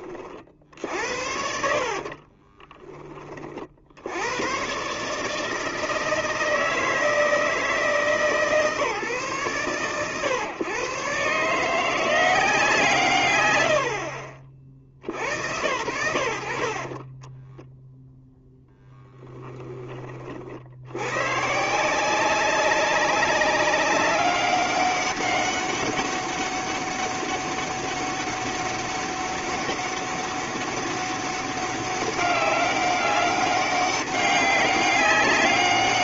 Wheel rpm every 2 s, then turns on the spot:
60, 20, 120, 160, 150, 130, 180, 60, 50, 0, 80, 190, 200, 200, 200, 200, 200, 200.
2-4 16-18